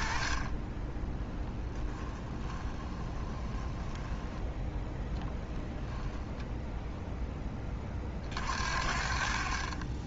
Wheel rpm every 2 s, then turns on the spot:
10, 20, 10, 0, 60.
2-4